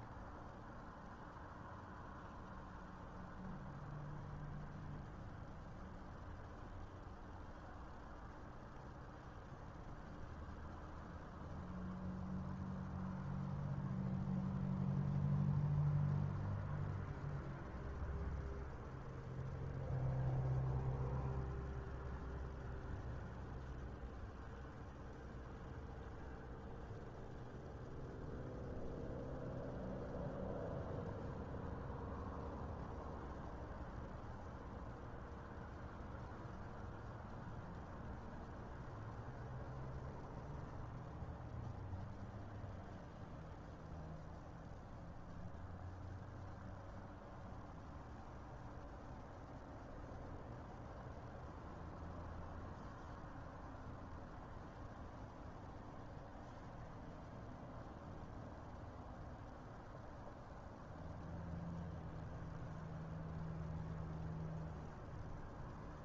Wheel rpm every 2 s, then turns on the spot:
0, 0, 0, 0, 0, 0, 0, 0, 0, 0, 0, 0, 0, 0, 0, 0, 0, 0, 0, 0, 0, 0, 0, 0, 0, 0, 0, 0, 0, 0, 0, 0, 0.
none